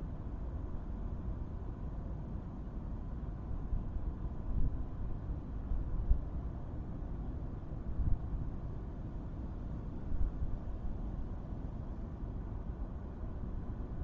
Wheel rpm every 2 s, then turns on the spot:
0, 0, 0, 0, 0, 0, 0.
none